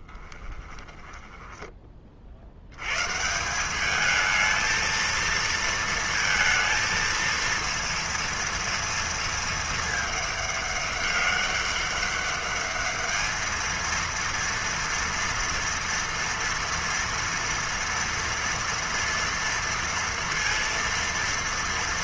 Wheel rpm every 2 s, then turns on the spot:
10, 70, 220, 230, 230, 210, 210, 230, 230, 230, 230.
0-2